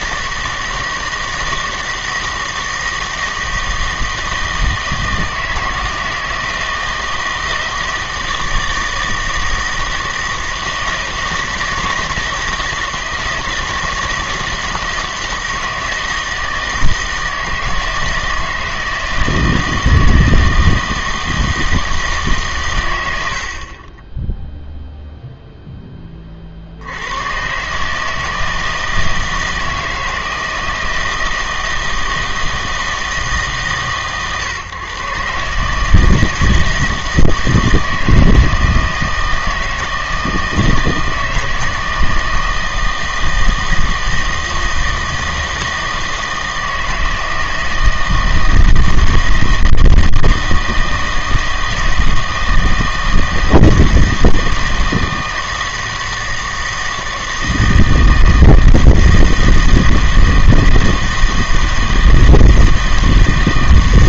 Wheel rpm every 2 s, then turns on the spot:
160, 160, 160, 160, 160, 160, 160, 160, 160, 160, 160, 120, 0, 60, 160, 160, 160, 130, 160, 160, 160, 160, 160, 160, 160, 160, 160, 160, 160, 160, 160, 160.
none